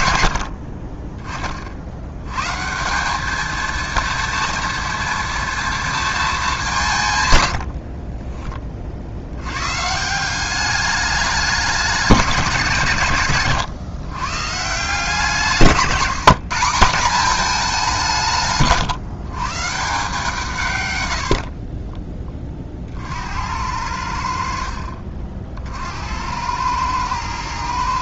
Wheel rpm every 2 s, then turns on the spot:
50, 200, 230, 130, 60, 210, 140, 160, 190, 150, 120, 40, 50, 110.
none